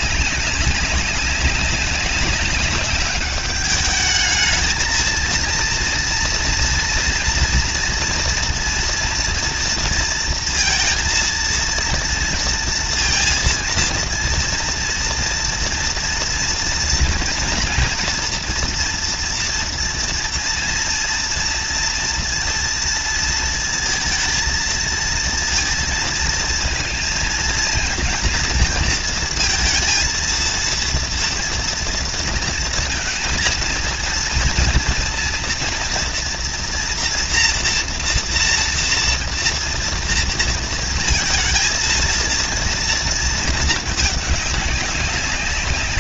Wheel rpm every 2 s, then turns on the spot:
200, 200, 210, 230, 230, 230, 230, 230, 230, 240, 230, 230, 230, 230, 230, 230, 230, 230, 230, 230, 230, 230, 210.
none